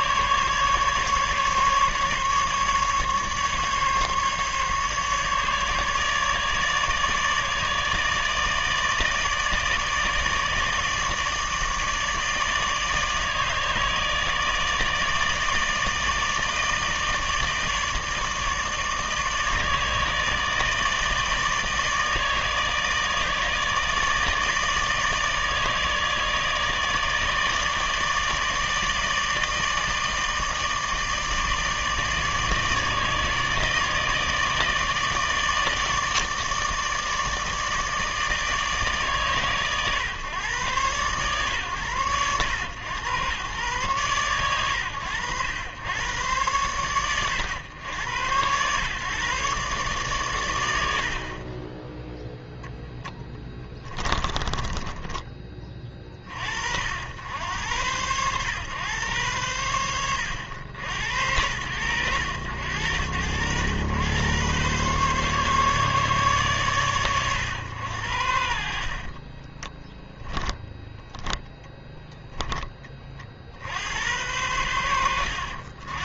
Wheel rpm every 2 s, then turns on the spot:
150, 150, 150, 150, 160, 160, 150, 150, 160, 160, 160, 150, 150, 150, 160, 150, 160, 150, 160, 140, 120, 110, 100, 100, 130, 90, 0, 10, 70, 100, 90, 90, 140, 120, 60, 0, 20, 80.
54-56